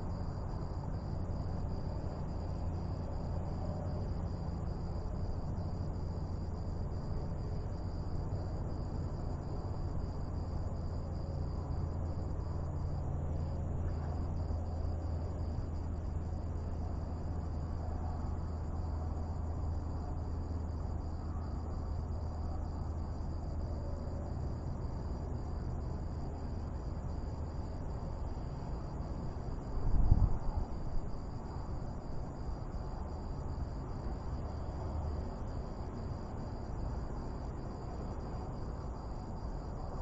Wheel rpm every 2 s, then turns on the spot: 0, 0, 0, 0, 0, 0, 0, 0, 0, 0, 0, 0, 0, 0, 0, 0, 0, 0, 0, 0.
none